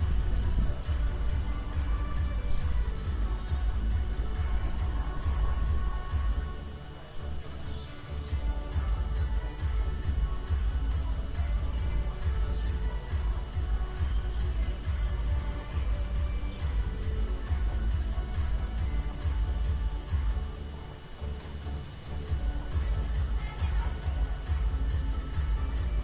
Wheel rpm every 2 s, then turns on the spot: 0, 0, 0, 0, 0, 0, 0, 0, 0, 0, 0, 0, 0.
none